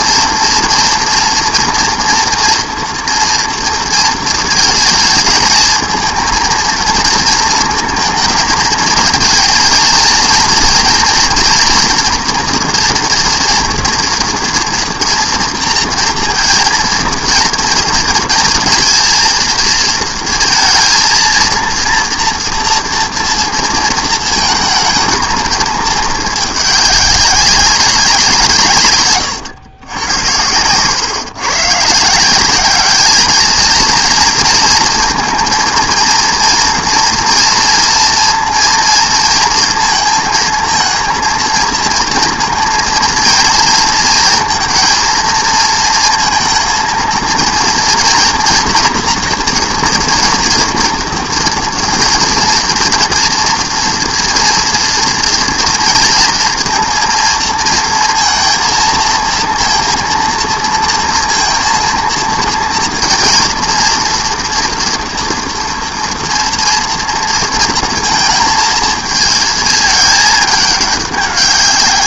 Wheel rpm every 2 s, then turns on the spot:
240, 230, 220, 230, 220, 230, 230, 230, 230, 230, 230, 230, 220, 200, 140, 120, 210, 220, 230, 230, 230, 230, 230, 230, 230, 230, 240, 230, 230, 230, 230, 230, 230, 230, 220, 200.
none